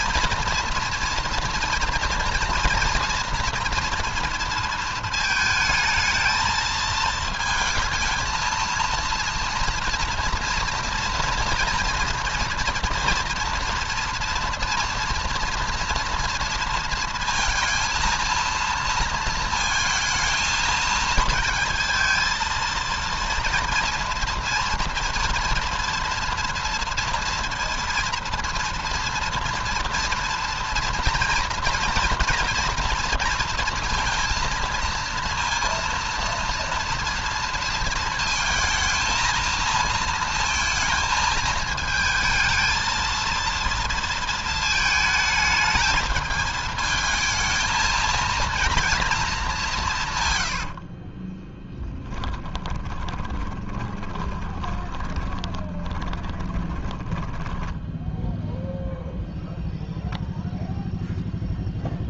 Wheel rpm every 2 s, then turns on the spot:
230, 230, 230, 220, 230, 230, 230, 230, 230, 220, 220, 230, 230, 230, 230, 240, 230, 230, 230, 220, 220, 220, 220, 220, 230, 70, 20, 20, 20, 0, 0.
50-58